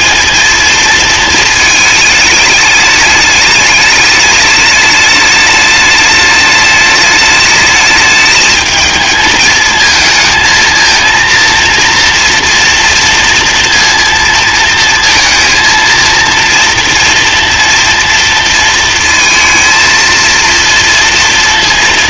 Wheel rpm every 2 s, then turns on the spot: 220, 210, 210, 210, 220, 220, 230, 230, 230, 230, 230.
none